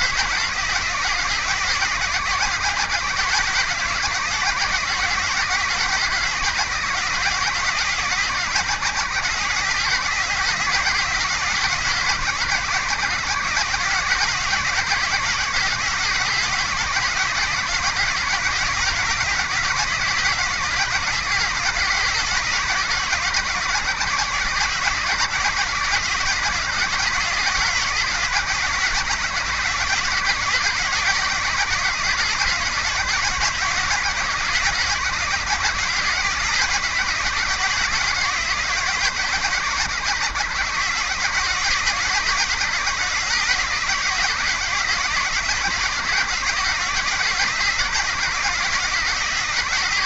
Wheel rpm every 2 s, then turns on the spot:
130, 130, 130, 130, 130, 140, 130, 130, 130, 130, 130, 130, 130, 130, 130, 130, 130, 130, 130, 130, 120, 130, 130, 130, 130.
none